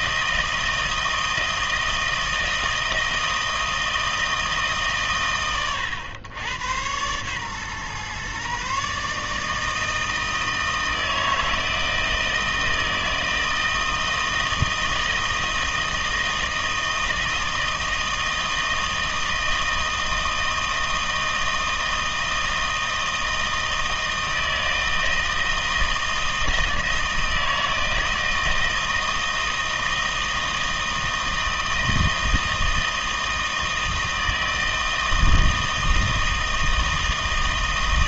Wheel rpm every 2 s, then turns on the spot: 160, 160, 150, 110, 140, 160, 160, 160, 160, 160, 160, 160, 160, 160, 160, 160, 160, 160, 160.
none